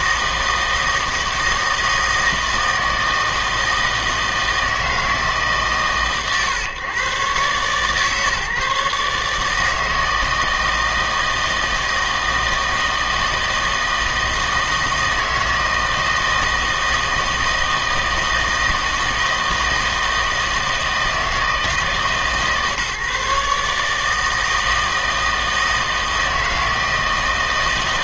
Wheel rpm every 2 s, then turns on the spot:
160, 160, 160, 130, 150, 160, 160, 160, 160, 160, 160, 140, 160, 160.
none